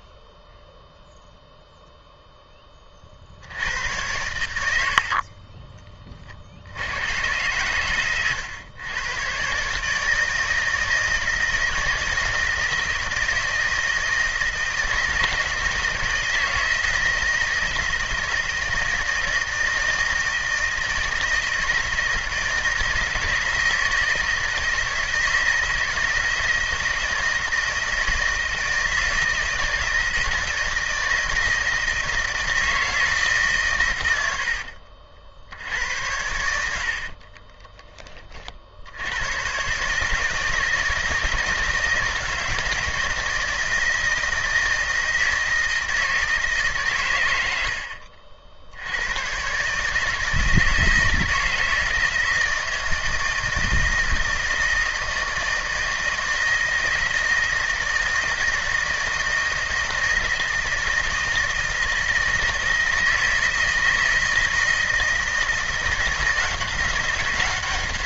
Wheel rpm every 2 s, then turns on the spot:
0, 20, 80, 80, 100, 160, 160, 160, 160, 160, 160, 160, 160, 160, 160, 160, 160, 70, 80, 50, 160, 160, 160, 140, 70, 160, 160, 160, 160, 160, 160, 160, 160, 180.
36-38